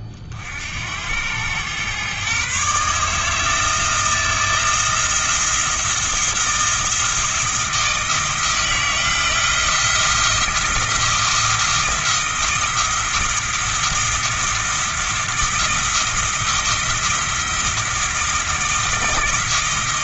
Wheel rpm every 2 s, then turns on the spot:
80, 140, 170, 170, 160, 170, 170, 170, 170, 160.
none